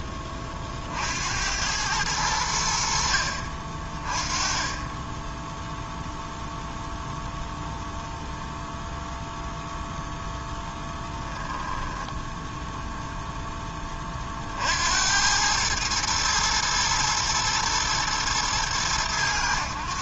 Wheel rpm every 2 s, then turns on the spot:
40, 80, 20, 0, 0, 10, 0, 50, 110, 110.
none